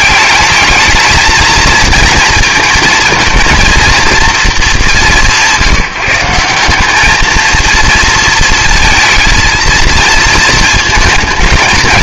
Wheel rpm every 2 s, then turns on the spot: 210, 230, 220, 180, 230, 220.
none